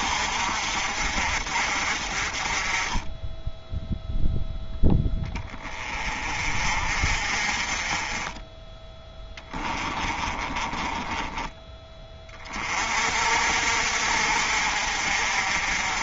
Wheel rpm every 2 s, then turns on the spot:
50, 30, 10, 40, 10, 20, 40, 50.
10-12